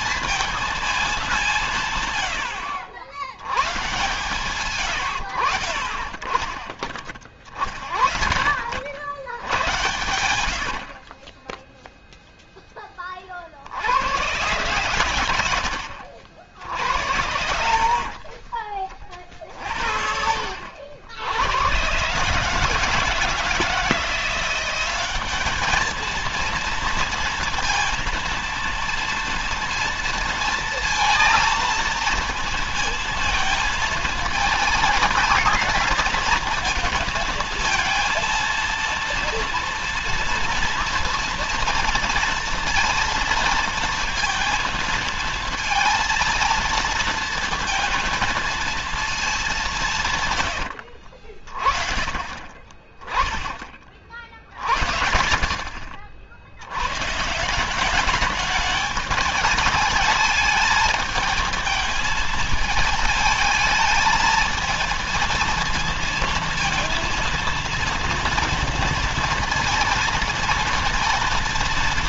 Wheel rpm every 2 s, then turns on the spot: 220, 70, 120, 30, 70, 70, 10, 110, 60, 40, 80, 150, 180, 230, 230, 230, 220, 220, 230, 230, 230, 230, 230, 230, 230, 80, 30, 70, 100, 210, 220, 220, 230, 230, 230, 230.
50-52